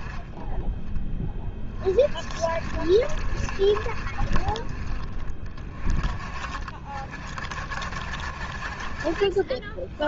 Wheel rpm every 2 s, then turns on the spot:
10, 50, 40, 40, 50.
none